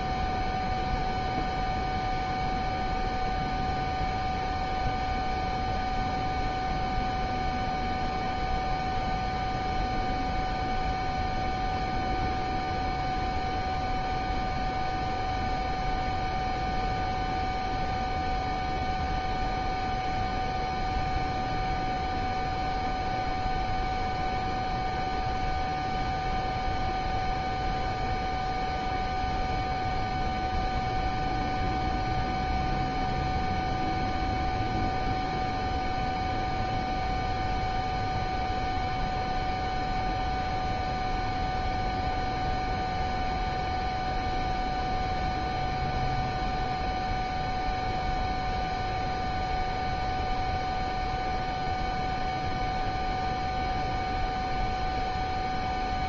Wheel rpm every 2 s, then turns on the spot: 0, 0, 0, 0, 0, 0, 0, 0, 0, 0, 0, 0, 0, 0, 0, 0, 0, 0, 0, 0, 0, 0, 0, 0, 0, 0, 0, 0.
none